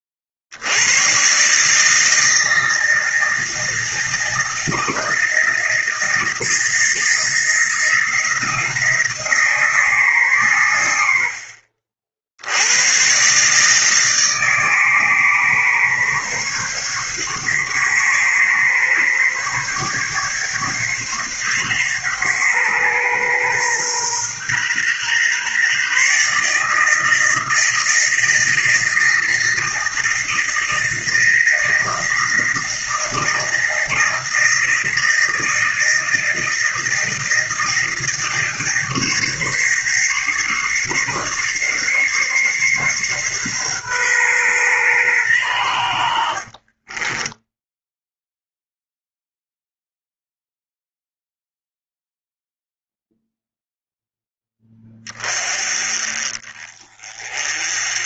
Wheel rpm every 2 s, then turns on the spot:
50, 160, 160, 160, 170, 120, 90, 150, 140, 140, 140, 130, 120, 150, 160, 160, 160, 160, 160, 160, 150, 140, 120, 30, 0, 0, 0, 20, 30.
46-48